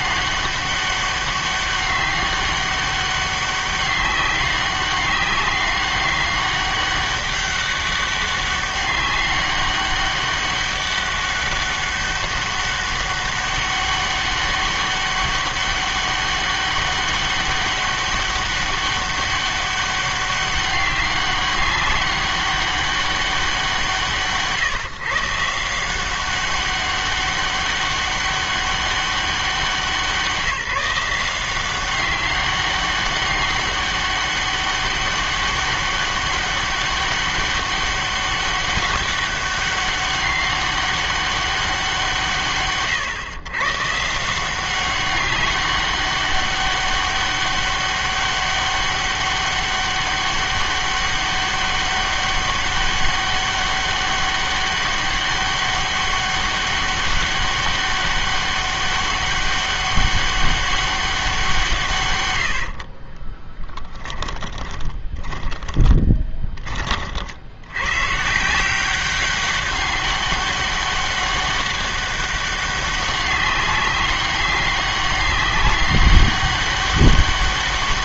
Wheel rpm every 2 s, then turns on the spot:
200, 200, 200, 200, 200, 200, 200, 200, 200, 200, 200, 200, 150, 190, 200, 170, 200, 200, 200, 200, 200, 140, 180, 200, 200, 200, 200, 200, 200, 200, 200, 80, 20, 30, 170, 200, 200, 190, 200.
62-66